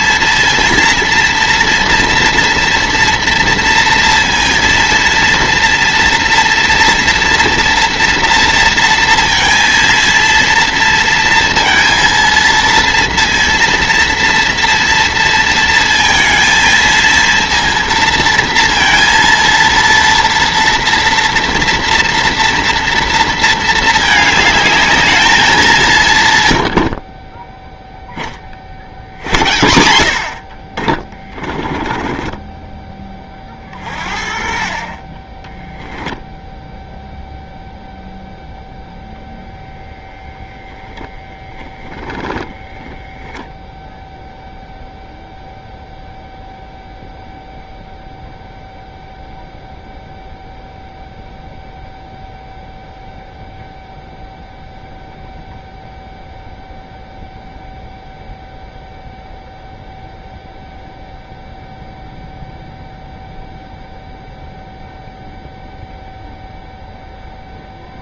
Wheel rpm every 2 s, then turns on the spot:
230, 230, 230, 230, 230, 230, 230, 230, 230, 230, 240, 230, 210, 50, 60, 30, 20, 30, 0, 0, 0, 10, 0, 0, 0, 0, 0, 0, 0, 0, 0, 0, 0, 0.
26-28 30-32